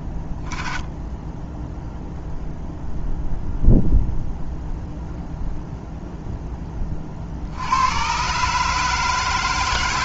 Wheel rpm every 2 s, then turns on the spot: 20, 0, 0, 10, 140.
none